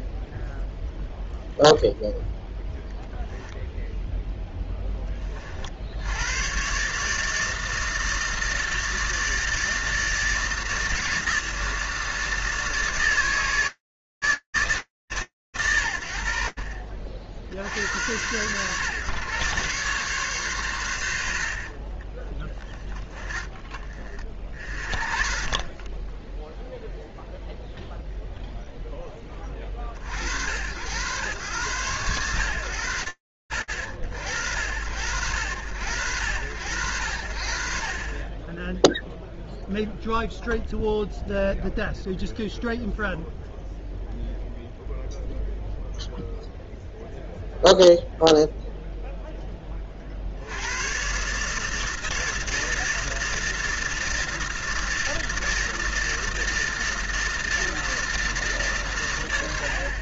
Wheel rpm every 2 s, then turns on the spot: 0, 0, 10, 110, 160, 160, 160, 100, 80, 130, 70, 30, 10, 0, 70, 100, 70, 80, 20, 0, 0, 0, 0, 0, 60, 160, 160, 160, 160, 20.
none